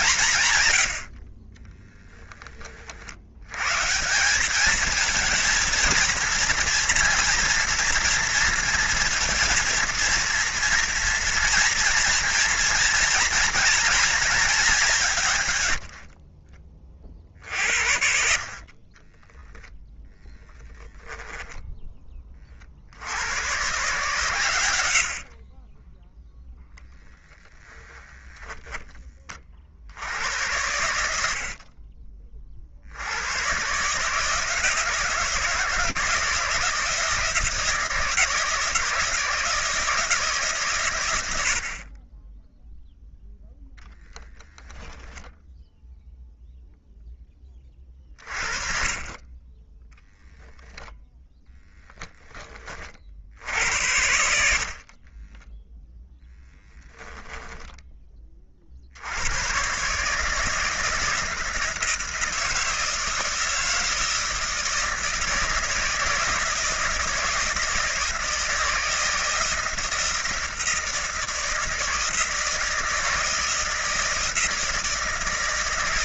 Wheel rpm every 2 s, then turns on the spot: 120, 30, 210, 230, 230, 230, 230, 190, 40, 40, 10, 50, 90, 0, 10, 90, 60, 160, 160, 160, 130, 10, 20, 0, 40, 0, 30, 50, 0, 60, 160, 160, 160, 160, 160, 160, 160, 160.
20-22 42-46 48-50